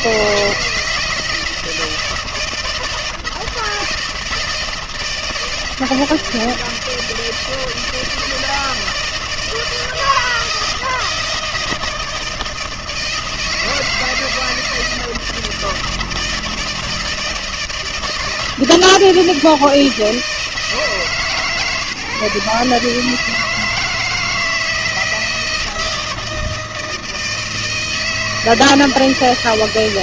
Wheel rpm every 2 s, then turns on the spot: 160, 160, 160, 160, 160, 160, 160, 160, 160, 160, 160, 150, 160, 160, 160.
none